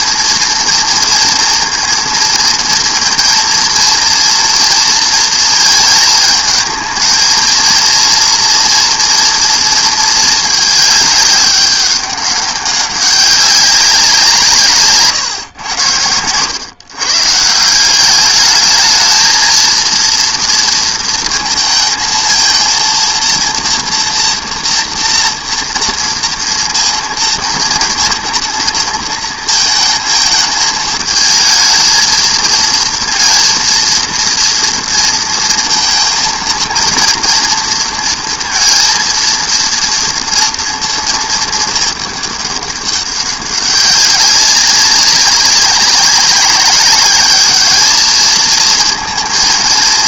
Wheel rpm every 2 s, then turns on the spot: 230, 230, 230, 220, 230, 220, 200, 160, 110, 210, 230, 230, 230, 230, 230, 220, 230, 230, 230, 230, 230, 200, 200, 200, 220.
none